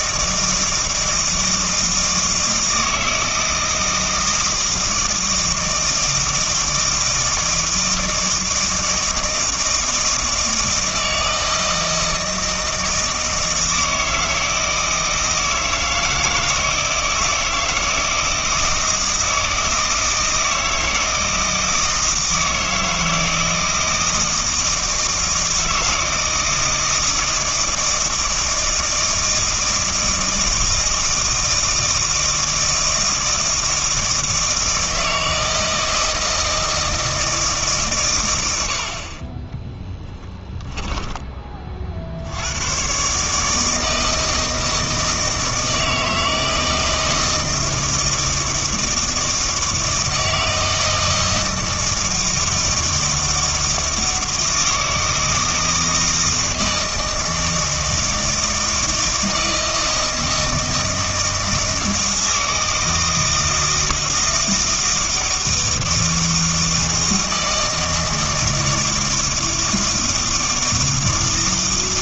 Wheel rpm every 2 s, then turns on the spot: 160, 160, 160, 160, 160, 160, 160, 160, 160, 160, 160, 160, 160, 160, 160, 160, 160, 160, 160, 60, 10, 110, 160, 160, 160, 160, 160, 160, 160, 160, 160, 160, 160, 160, 160, 160.
40-42